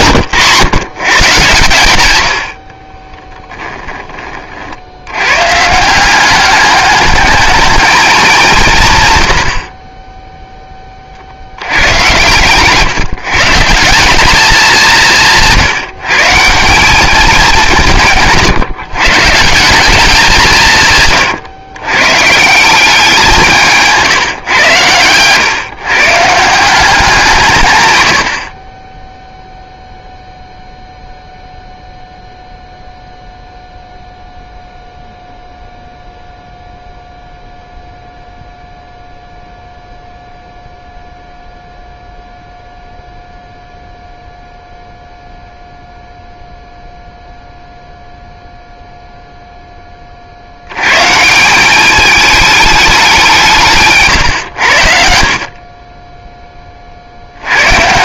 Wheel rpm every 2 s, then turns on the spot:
140, 50, 60, 210, 150, 20, 140, 200, 180, 150, 150, 170, 120, 170, 30, 0, 0, 0, 0, 0, 0, 0, 0, 0, 0, 100, 210, 80, 30.
none